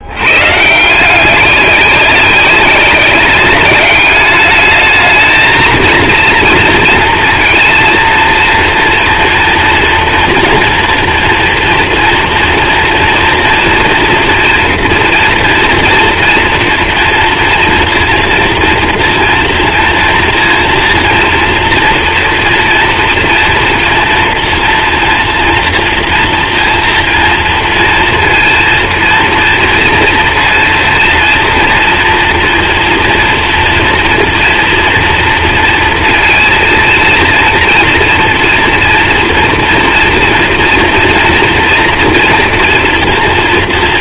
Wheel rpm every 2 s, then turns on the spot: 140, 190, 210, 230, 230, 240, 230, 240, 240, 230, 230, 230, 230, 230, 230, 230, 230, 230, 230, 230, 230, 230.
none